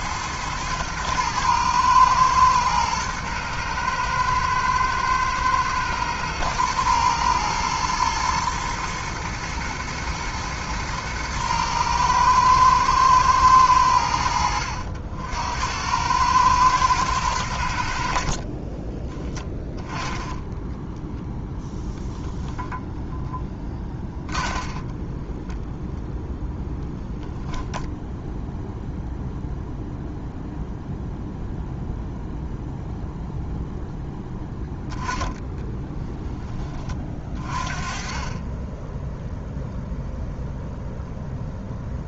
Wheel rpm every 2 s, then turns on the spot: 110, 110, 110, 110, 120, 110, 110, 70, 110, 20, 10, 20, 10, 0, 0, 0, 0, 10, 30, 10, 0.
20-26 34-36